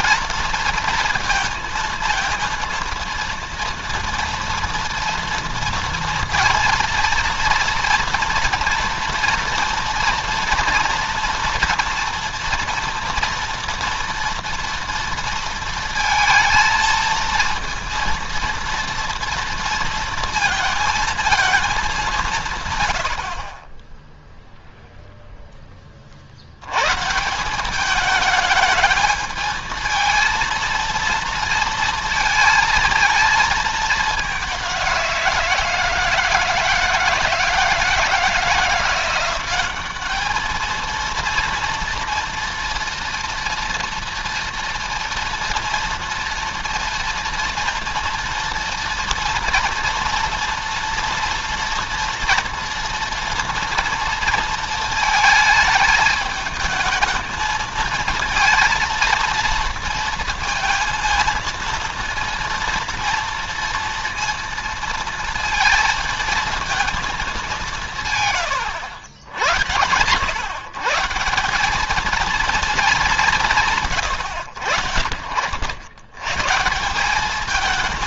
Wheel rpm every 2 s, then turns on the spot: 230, 230, 230, 230, 230, 230, 240, 240, 230, 230, 230, 130, 0, 90, 210, 230, 220, 190, 170, 170, 220, 230, 230, 230, 240, 230, 240, 220, 220, 230, 220, 230, 230, 230, 100, 130, 220, 90, 160.
none